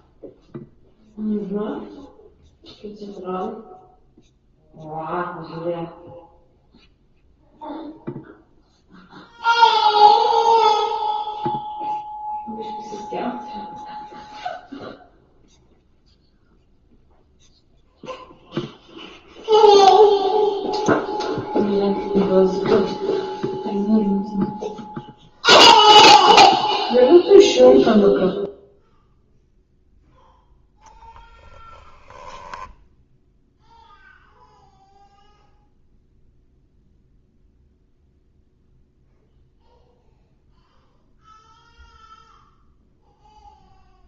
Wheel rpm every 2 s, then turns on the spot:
0, 0, 0, 0, 0, 0, 0, 0, 0, 0, 0, 0, 0, 0, 0, 10, 10, 0, 0, 0, 0, 0.
32-34